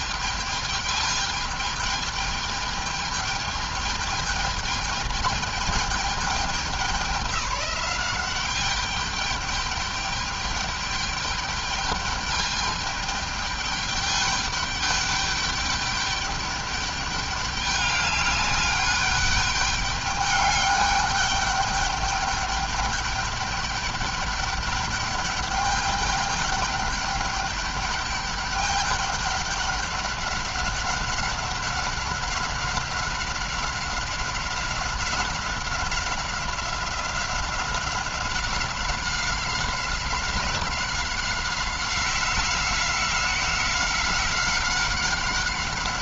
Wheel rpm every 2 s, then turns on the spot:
220, 210, 210, 200, 200, 210, 210, 210, 200, 200, 210, 210, 210, 200, 200, 200, 190, 190, 190, 190, 190, 180, 190.
none